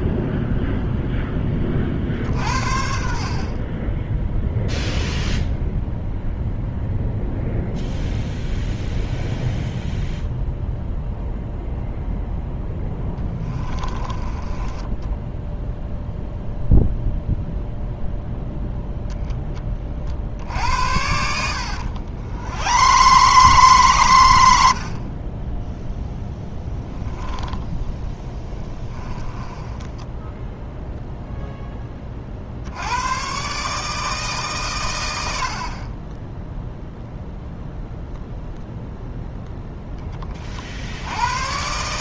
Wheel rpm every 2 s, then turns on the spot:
0, 50, 0, 0, 0, 0, 10, 10, 0, 0, 80, 110, 50, 10, 20, 0, 100, 110, 0, 0, 70.
12-14 20-24 26-30